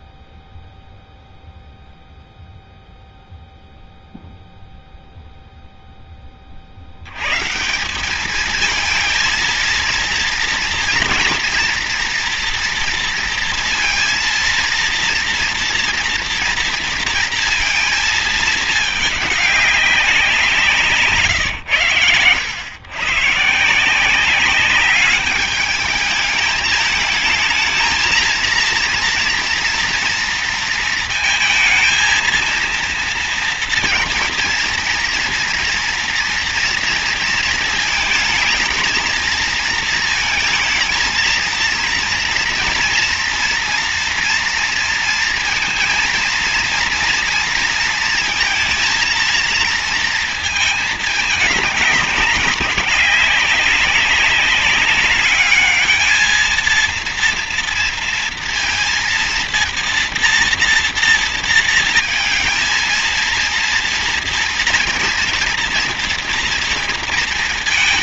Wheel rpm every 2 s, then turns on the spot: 0, 0, 0, 30, 210, 230, 240, 230, 230, 220, 180, 110, 190, 210, 230, 230, 230, 230, 230, 220, 230, 230, 240, 230, 230, 230, 200, 200, 220, 230, 230, 220, 230, 230.
none